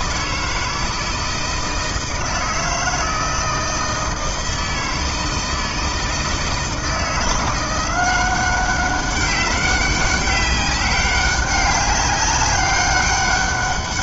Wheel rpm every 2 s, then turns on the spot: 160, 160, 160, 170, 200, 190, 200.
none